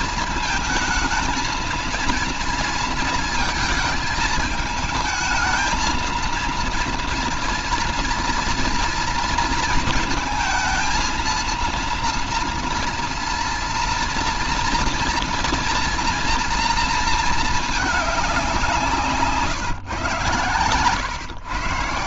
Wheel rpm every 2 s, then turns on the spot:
220, 230, 220, 230, 240, 220, 230, 230, 230, 170, 110.
none